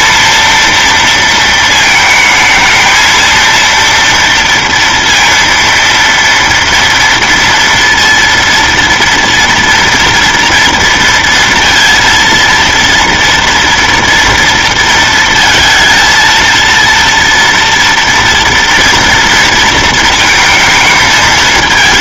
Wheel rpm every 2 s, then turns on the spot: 230, 220, 230, 230, 230, 230, 230, 230, 230, 230, 220.
none